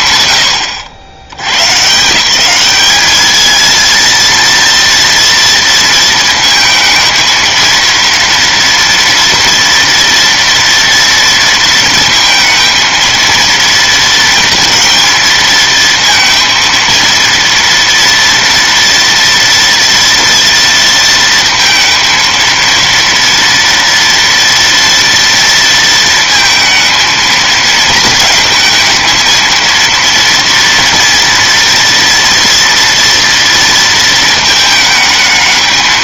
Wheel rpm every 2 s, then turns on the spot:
100, 220, 230, 230, 230, 230, 230, 230, 230, 230, 230, 230, 230, 220, 230, 230, 230, 220.
none